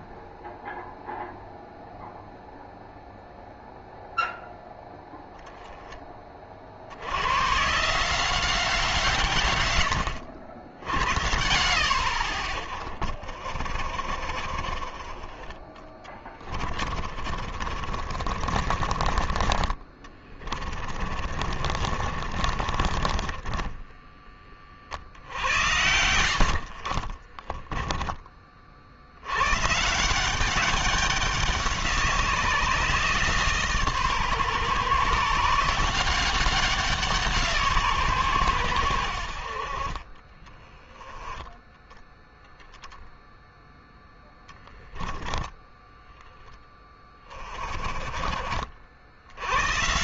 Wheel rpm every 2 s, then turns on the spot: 0, 0, 0, 70, 170, 80, 40, 30, 30, 30, 30, 30, 50, 40, 60, 190, 160, 140, 180, 100, 20, 0, 10, 20, 70.
16-24 26-28